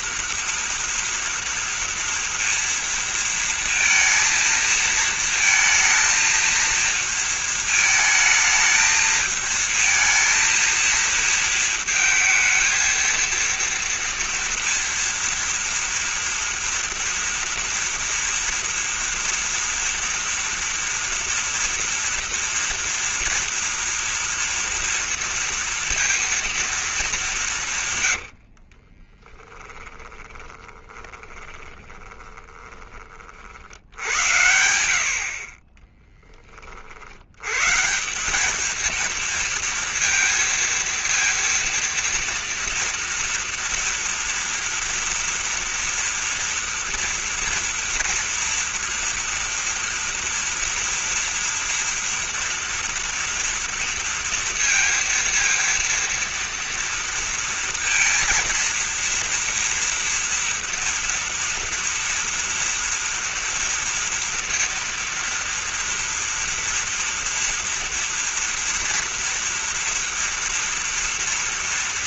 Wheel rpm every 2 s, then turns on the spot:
230, 230, 230, 230, 220, 230, 230, 230, 230, 230, 240, 230, 230, 220, 30, 20, 30, 80, 50, 220, 230, 230, 230, 230, 230, 230, 230, 230, 230, 230, 230, 230, 230, 230, 230, 230.
28-32